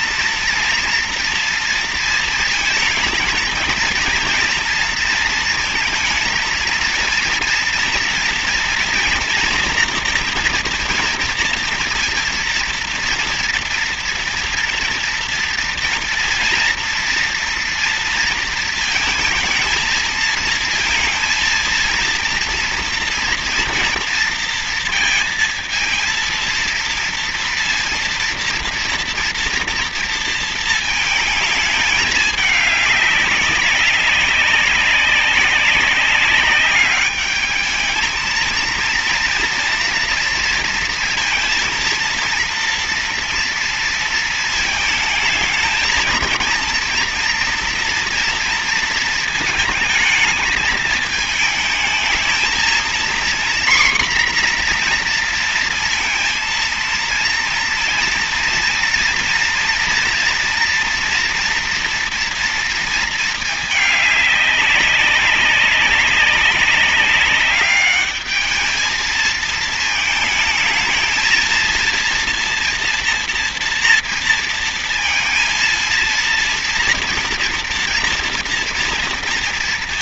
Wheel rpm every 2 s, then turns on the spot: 230, 230, 230, 230, 240, 230, 230, 230, 230, 230, 220, 230, 230, 230, 230, 230, 210, 200, 200, 230, 230, 230, 220, 230, 230, 210, 220, 250, 230, 230, 230, 230, 200, 200, 210, 220, 230, 230, 230, 240.
none